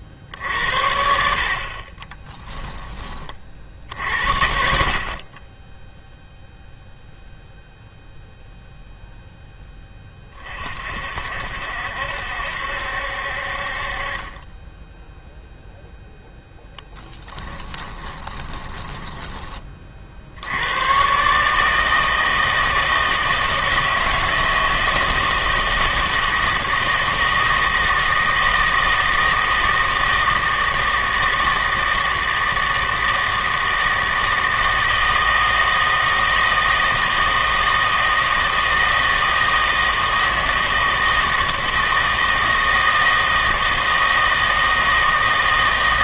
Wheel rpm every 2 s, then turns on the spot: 60, 20, 50, 0, 0, 50, 70, 10, 10, 10, 110, 160, 160, 160, 160, 160, 160, 160, 160, 160, 160, 160, 160.
18-20